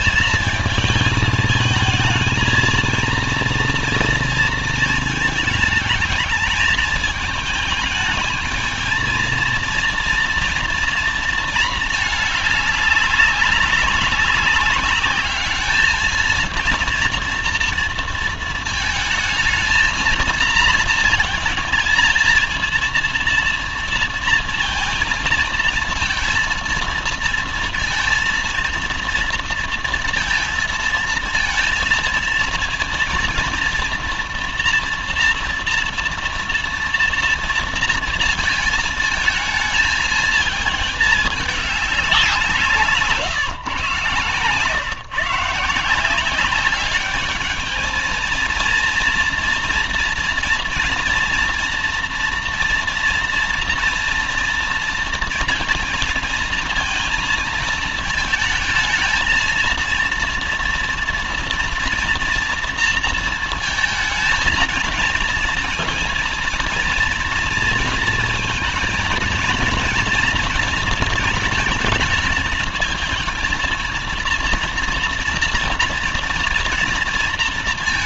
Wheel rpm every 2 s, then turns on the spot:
220, 220, 230, 210, 220, 230, 210, 200, 230, 230, 230, 230, 230, 230, 230, 230, 230, 230, 230, 230, 220, 190, 130, 190, 230, 230, 240, 230, 230, 220, 230, 230, 220, 230, 230, 240, 220, 230, 230.
none